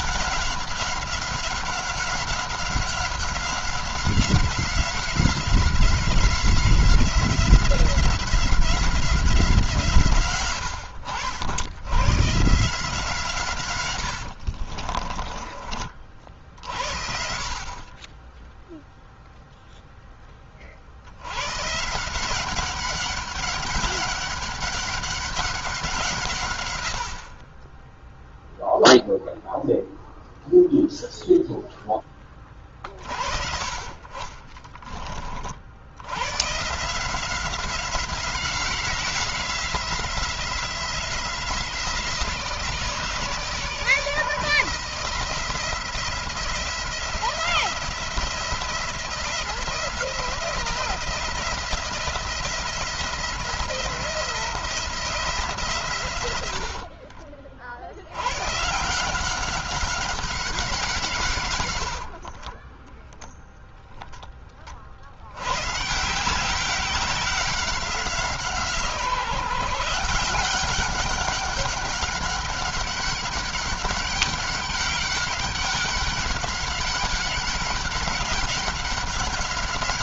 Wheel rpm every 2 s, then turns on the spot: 190, 190, 180, 180, 180, 80, 150, 40, 70, 0, 60, 190, 200, 110, 0, 0, 40, 30, 150, 180, 170, 160, 170, 170, 170, 170, 170, 170, 70, 150, 170, 10, 50, 190, 170, 190, 200, 190, 200, 190.
14-16 56-58 62-64